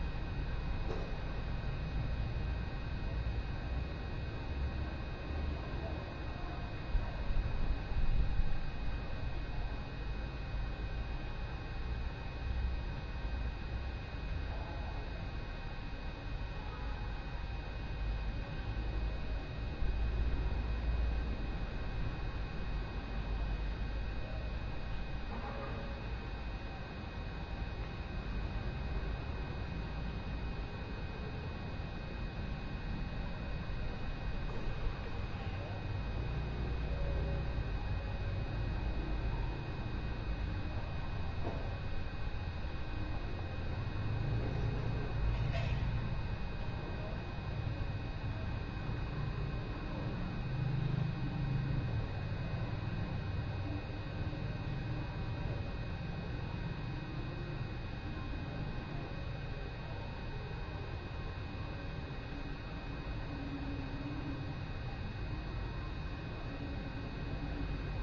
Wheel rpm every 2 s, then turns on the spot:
0, 0, 0, 0, 0, 0, 0, 0, 0, 0, 0, 0, 0, 0, 0, 0, 0, 0, 0, 0, 0, 0, 0, 0, 0, 0, 0, 0, 0, 0, 0, 0, 0, 0.
none